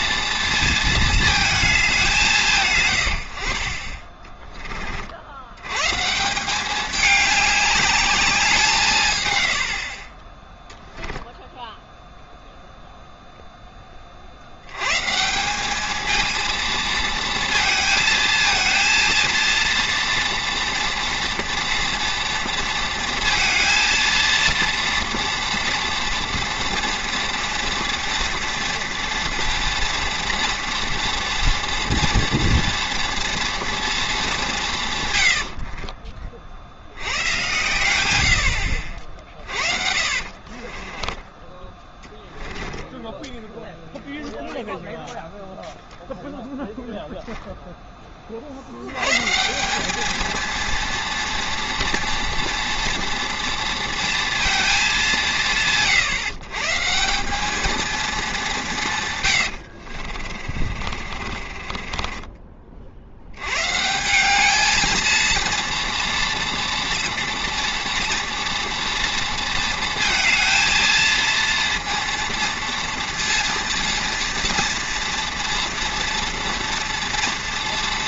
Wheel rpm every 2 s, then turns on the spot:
230, 150, 30, 200, 180, 10, 0, 90, 230, 230, 230, 230, 230, 230, 230, 230, 240, 180, 60, 80, 40, 10, 0, 0, 50, 230, 230, 220, 140, 180, 40, 40, 210, 230, 230, 230, 230, 230, 230.
10-12 40-42 60-62